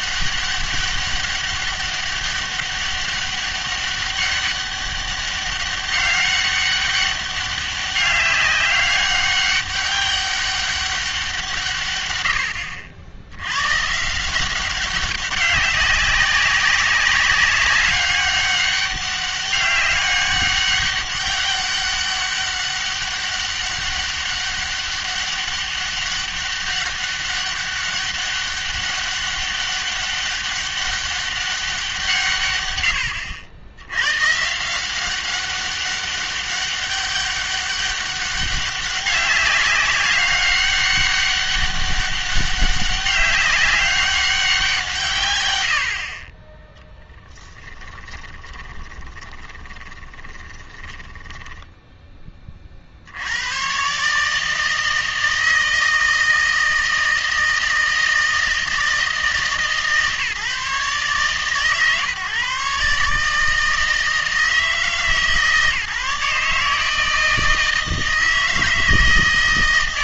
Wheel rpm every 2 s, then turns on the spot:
200, 200, 200, 200, 200, 200, 80, 190, 200, 200, 200, 200, 200, 200, 200, 200, 120, 160, 200, 200, 200, 200, 180, 10, 20, 20, 40, 160, 160, 160, 140, 140, 160, 160, 160.
48-52